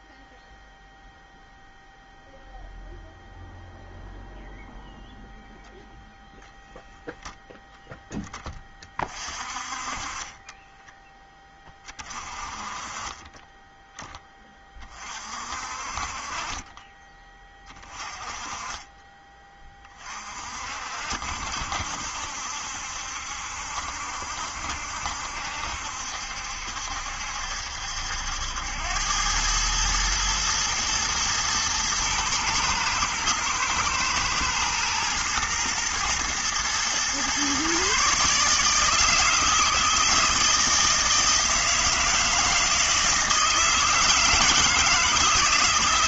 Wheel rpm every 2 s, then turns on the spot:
0, 0, 0, 0, 30, 10, 30, 30, 20, 20, 60, 70, 70, 70, 90, 120, 110, 110, 120, 160, 160, 160, 160.
10-12 16-18